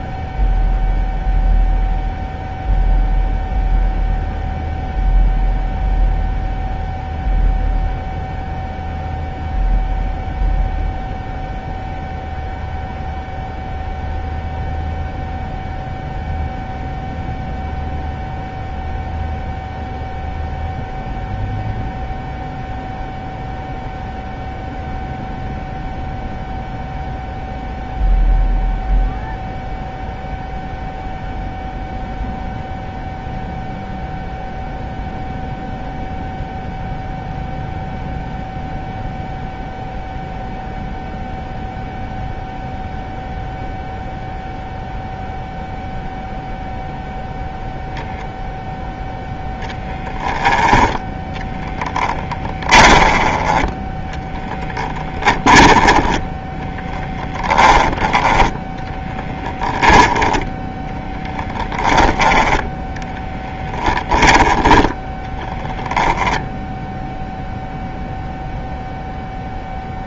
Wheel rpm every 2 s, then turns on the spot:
0, 0, 0, 0, 0, 0, 0, 0, 0, 0, 0, 0, 0, 0, 0, 0, 0, 0, 0, 0, 0, 0, 0, 0, 0, 10, 10, 20, 20, 20, 10, 10, 10, 0, 0.
54-58